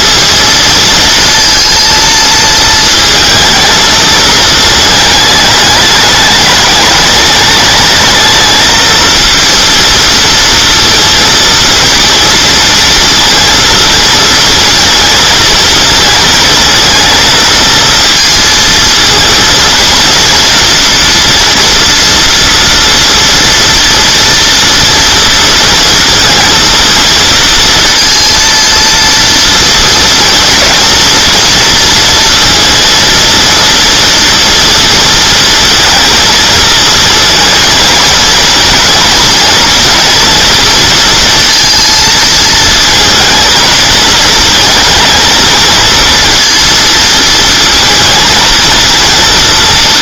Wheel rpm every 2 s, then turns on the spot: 230, 220, 220, 210, 220, 230, 230, 220, 230, 230, 240, 240, 230, 230, 230, 230, 230, 230, 230, 230, 230, 230, 230, 230, 220.
none